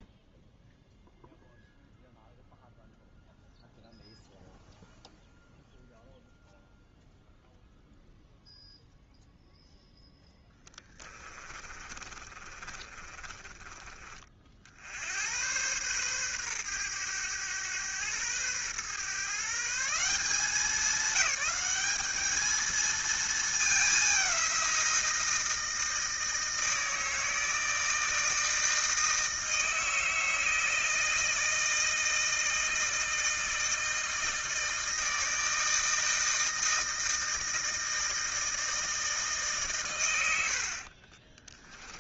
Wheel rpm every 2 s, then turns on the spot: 0, 0, 0, 0, 0, 10, 30, 60, 110, 120, 200, 220, 180, 160, 160, 160, 160, 160, 160, 160, 50.
10-14